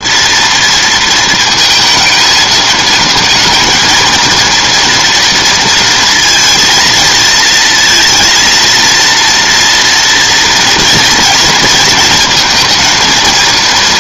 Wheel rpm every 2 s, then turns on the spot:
230, 220, 230, 230, 230, 230, 230.
none